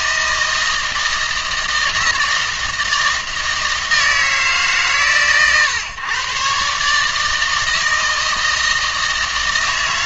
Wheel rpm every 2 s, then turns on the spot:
160, 160, 150, 140, 160.
none